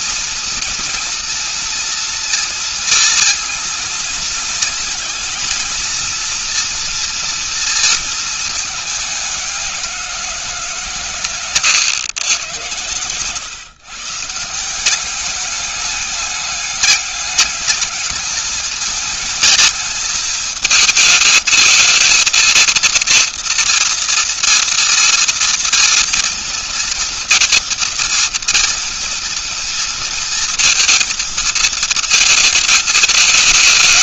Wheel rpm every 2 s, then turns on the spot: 230, 230, 230, 230, 220, 180, 110, 170, 200, 210, 220, 230, 230, 230, 230, 230, 220.
none